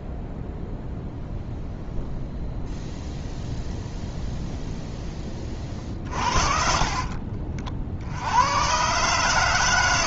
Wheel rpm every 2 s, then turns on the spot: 0, 0, 0, 40, 100.
6-8